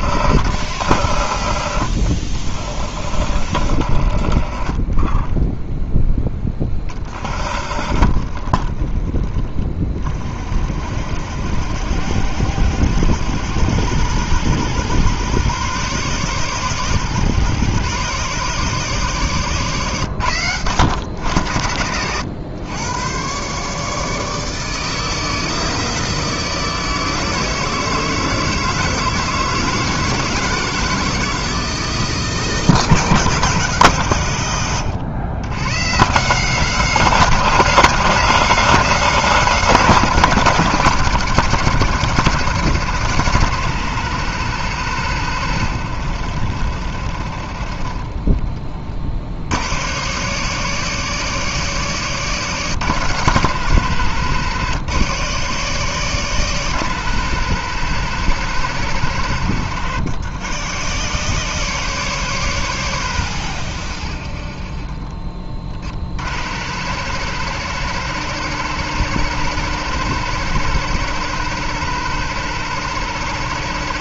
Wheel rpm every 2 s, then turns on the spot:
80, 40, 30, 30, 30, 60, 90, 120, 130, 140, 100, 110, 160, 160, 160, 160, 160, 100, 180, 180, 140, 120, 120, 60, 40, 150, 130, 130, 130, 110, 110, 130, 30, 90, 120, 130, 130.
none